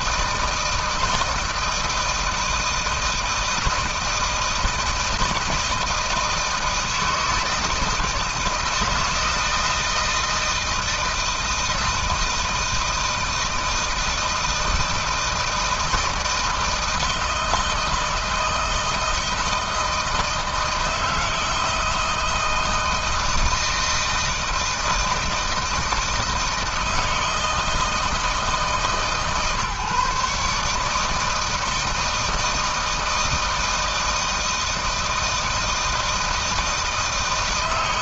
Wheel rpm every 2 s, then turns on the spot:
160, 160, 160, 160, 160, 160, 160, 160, 160, 160, 160, 160, 160, 160, 160, 150, 160, 160, 160.
none